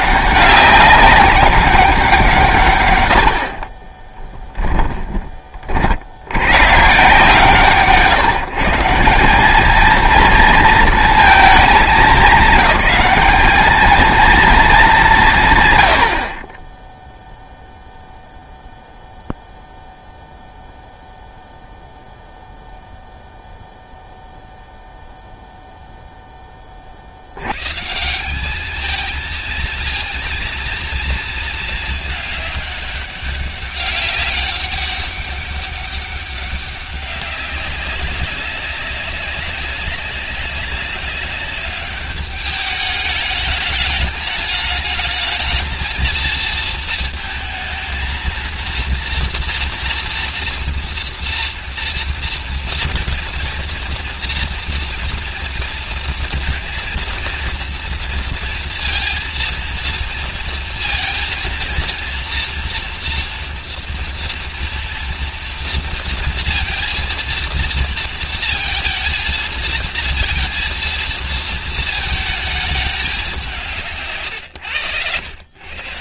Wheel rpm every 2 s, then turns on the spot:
200, 140, 10, 130, 160, 230, 210, 220, 20, 0, 0, 0, 0, 60, 220, 230, 200, 200, 200, 200, 200, 210, 220, 230, 230, 230, 240, 240, 230, 230, 230, 240, 230, 230, 230, 230, 200, 100.
none